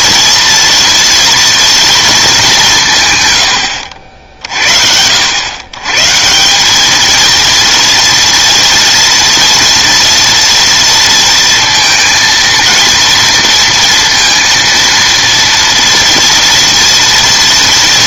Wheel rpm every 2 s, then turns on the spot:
230, 180, 60, 190, 230, 230, 230, 230, 230.
none